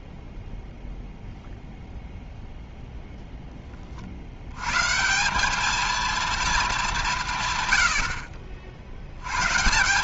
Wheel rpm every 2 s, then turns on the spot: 0, 70, 230, 70, 120.
none